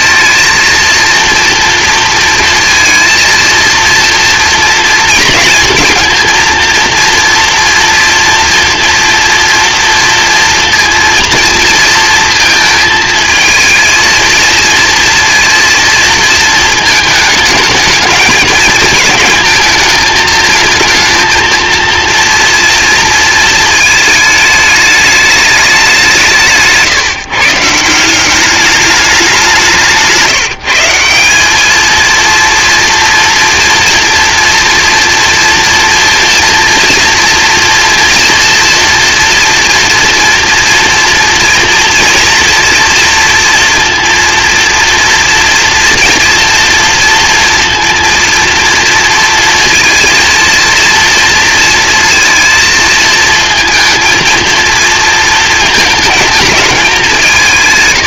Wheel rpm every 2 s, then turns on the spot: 230, 230, 240, 230, 230, 230, 230, 230, 220, 220, 220, 230, 210, 150, 210, 170, 230, 230, 230, 230, 230, 240, 230, 240, 230, 230, 230, 230, 210.
none